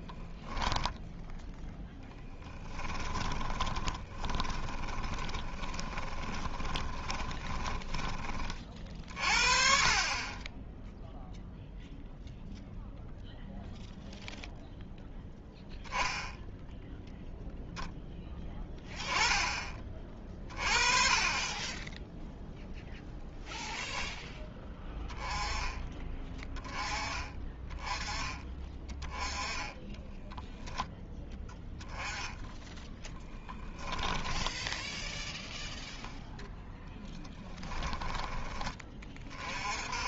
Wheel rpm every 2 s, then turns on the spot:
0, 20, 20, 20, 40, 0, 0, 0, 0, 10, 30, 0, 10, 20, 20, 10, 10, 10, 10, 20.
2-8 32-34